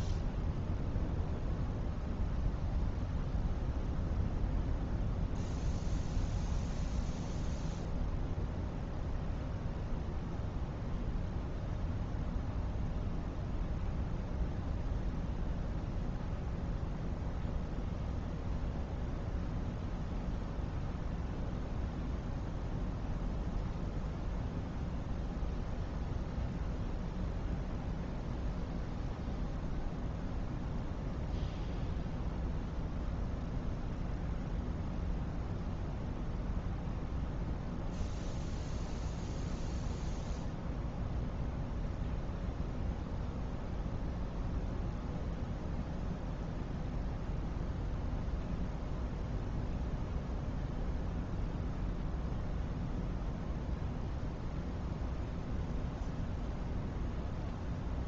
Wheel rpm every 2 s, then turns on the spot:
0, 0, 0, 0, 0, 0, 0, 0, 0, 0, 0, 0, 0, 0, 0, 0, 0, 0, 0, 0, 0, 0, 0, 0, 0, 0, 0, 0, 0.
none